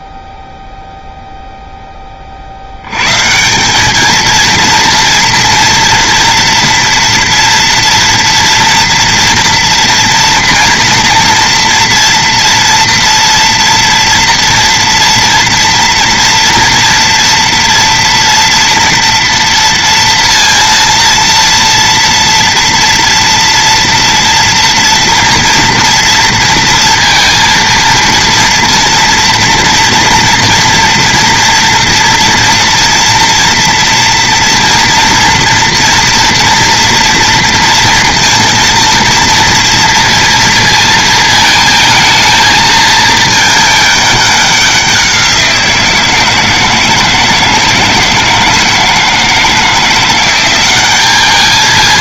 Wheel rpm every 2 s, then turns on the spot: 0, 60, 230, 230, 230, 230, 230, 230, 240, 230, 230, 230, 230, 230, 230, 230, 230, 230, 230, 230, 230, 220, 200, 160, 160, 180.
none